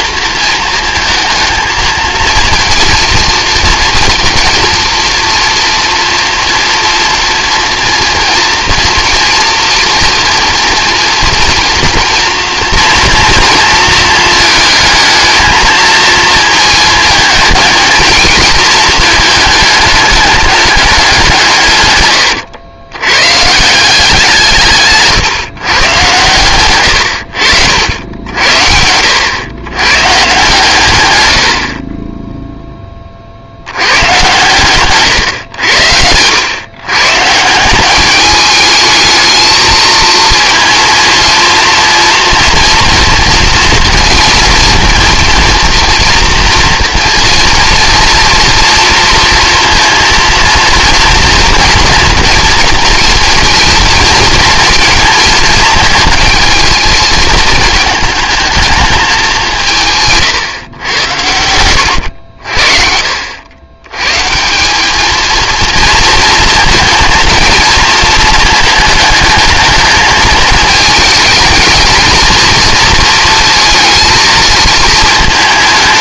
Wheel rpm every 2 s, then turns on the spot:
220, 230, 230, 230, 230, 240, 240, 220, 220, 220, 200, 100, 150, 120, 80, 130, 10, 130, 120, 210, 230, 240, 230, 230, 230, 230, 230, 230, 220, 220, 120, 60, 190, 220, 220, 220, 220, 220.
none